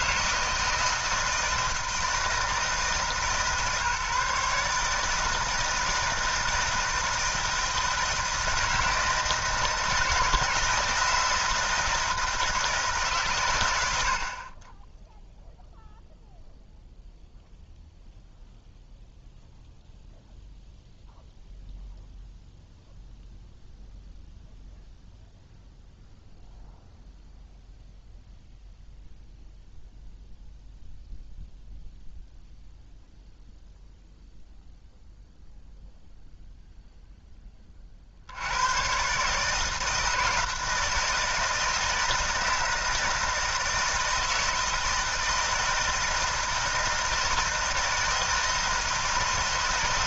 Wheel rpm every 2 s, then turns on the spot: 160, 160, 150, 160, 160, 170, 160, 10, 0, 0, 0, 0, 0, 0, 0, 0, 0, 0, 0, 130, 160, 160, 160, 160, 160.
none